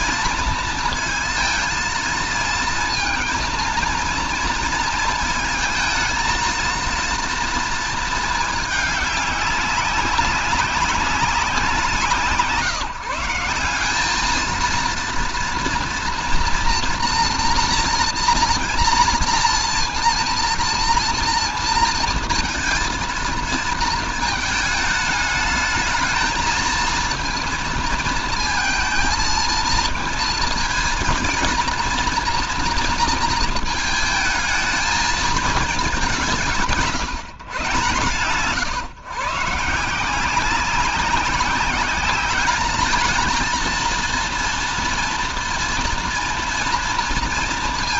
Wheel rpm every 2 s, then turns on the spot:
230, 230, 230, 230, 220, 190, 160, 230, 240, 230, 230, 230, 220, 220, 230, 220, 230, 220, 160, 130, 190, 210, 230, 230.
none